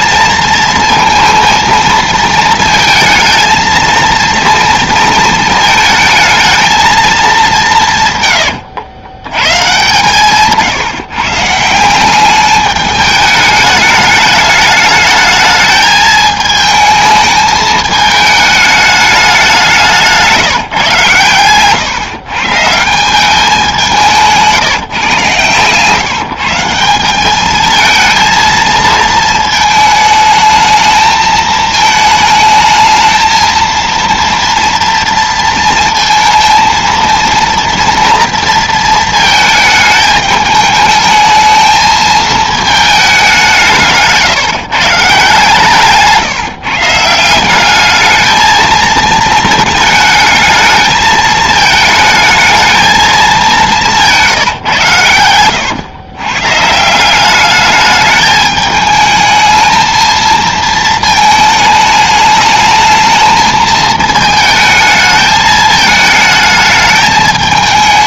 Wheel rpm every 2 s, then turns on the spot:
230, 220, 230, 220, 90, 140, 210, 210, 220, 220, 160, 150, 160, 170, 230, 220, 220, 230, 230, 230, 220, 220, 150, 150, 220, 220, 220, 150, 140, 210, 220, 220, 220, 220.
8-12 54-56